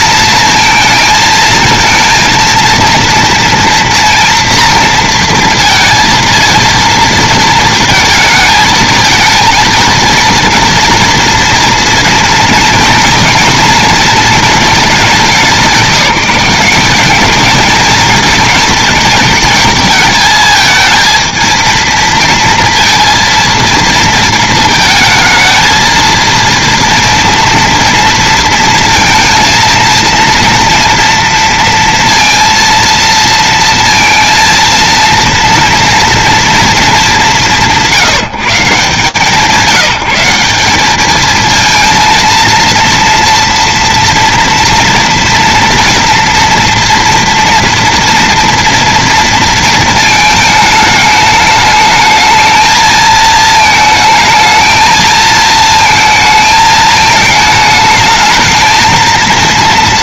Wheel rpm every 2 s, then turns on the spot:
230, 230, 230, 230, 220, 230, 230, 220, 190, 230, 220, 230, 220, 230, 230, 230, 230, 230, 200, 140, 200, 240, 230, 230, 230, 210, 220, 220, 220, 230.
none